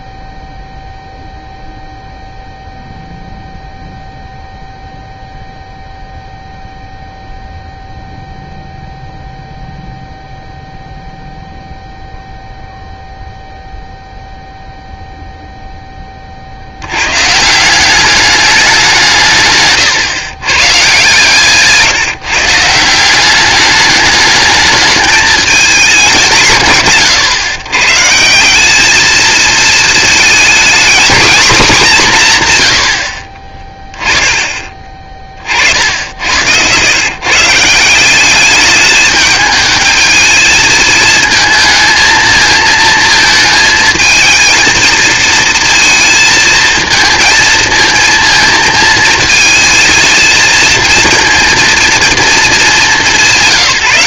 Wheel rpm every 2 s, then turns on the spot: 0, 0, 0, 0, 0, 0, 0, 0, 90, 190, 140, 160, 210, 150, 200, 230, 100, 20, 110, 210, 220, 220, 230, 220, 220, 230, 230.
32-34